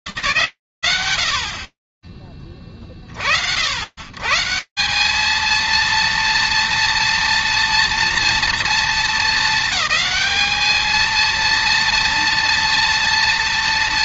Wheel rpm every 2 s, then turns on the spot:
90, 230, 230, 200, 230, 230, 120.
12-14